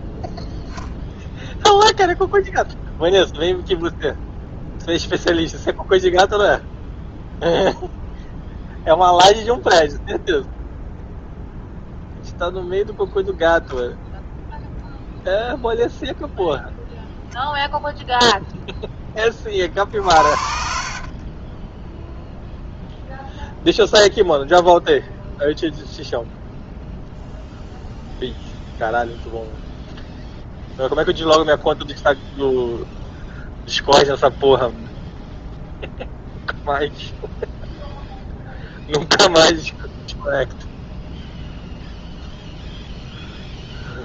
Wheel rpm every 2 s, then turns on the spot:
0, 0, 0, 0, 0, 0, 0, 0, 0, 10, 40, 0, 0, 0, 0, 0, 0, 0, 0, 0, 0, 0.
none